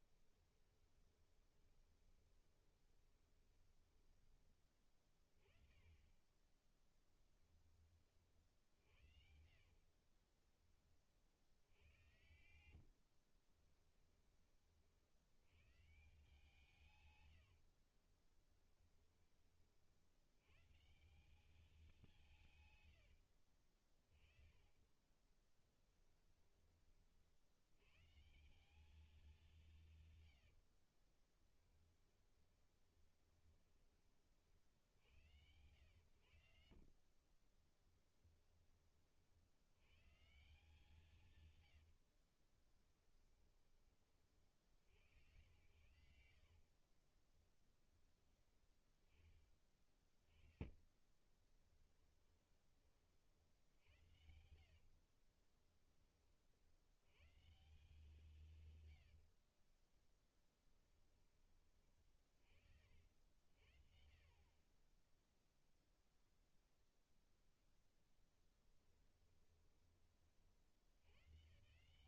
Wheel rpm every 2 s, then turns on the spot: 20, 20, 30, 10, 60, 30, 60, 70, 120, 20, 180, 90, 20, 40, 190, 30, 20, 80, 40, 40, 160, 20, 90, 20, 20, 30, 40, 40, 120, 90, 10, 50, 10, 0, 10, 100.
0-4 8-10 12-14 16-18 22-26 30-34 36-38 42-44 46-48 50-52 54-56 58-60 68-70